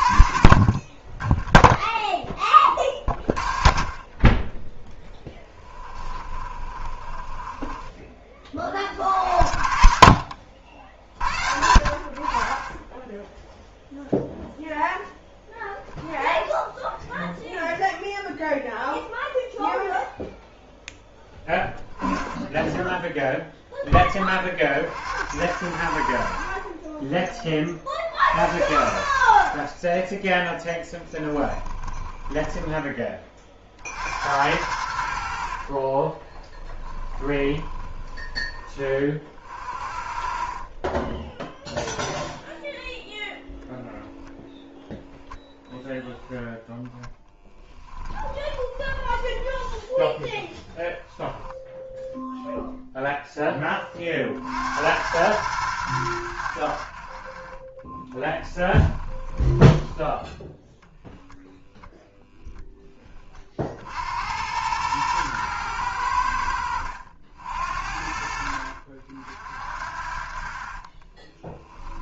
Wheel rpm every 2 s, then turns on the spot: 30, 20, 10, 30, 40, 60, 30, 0, 10, 0, 0, 0, 50, 50, 70, 10, 20, 80, 30, 20, 20, 0, 0, 0, 20, 10, 0, 70, 70, 20, 0, 10, 100, 70, 60, 40.
6-8 32-34 36-38 48-52 58-60 70-72